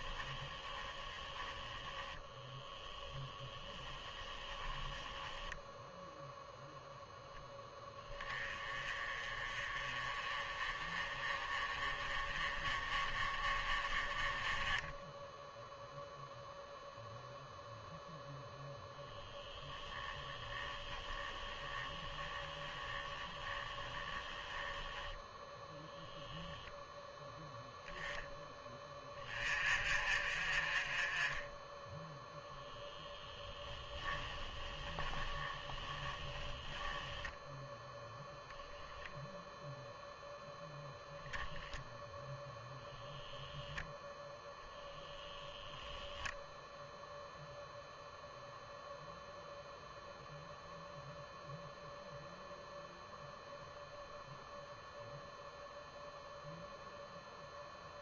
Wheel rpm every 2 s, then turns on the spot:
10, 10, 10, 0, 20, 30, 20, 20, 0, 0, 10, 10, 10, 0, 20, 30, 0, 20, 10, 0, 0, 0, 0, 0, 0, 0, 0, 0, 0.
0-6 20-26 34-38